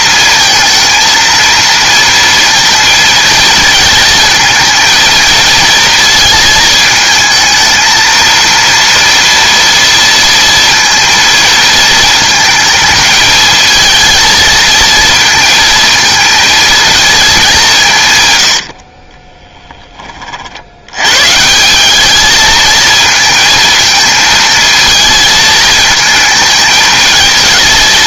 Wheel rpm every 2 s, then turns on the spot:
220, 230, 230, 220, 230, 230, 210, 230, 230, 90, 60, 220, 220, 220.
18-20